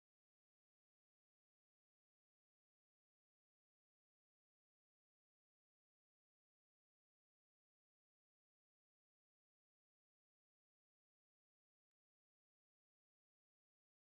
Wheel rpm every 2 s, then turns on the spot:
0, 0, 0, 0, 0, 0, 0.
none